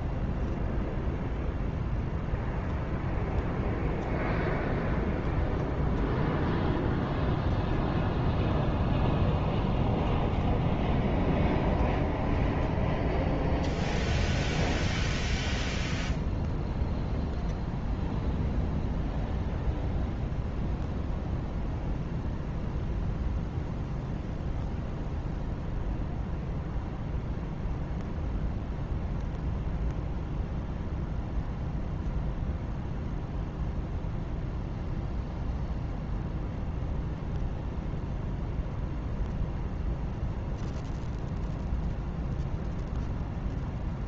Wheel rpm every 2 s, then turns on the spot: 0, 0, 0, 0, 0, 0, 0, 0, 0, 0, 0, 0, 0, 0, 0, 0, 0, 0, 0, 0, 0, 0.
none